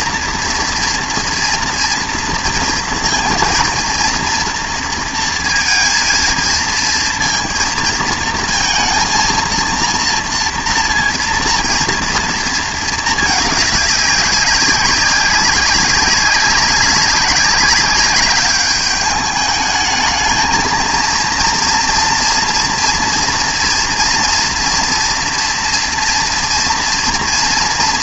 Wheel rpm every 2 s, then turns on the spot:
240, 230, 230, 230, 220, 230, 220, 190, 200, 200, 220, 230, 240, 230.
none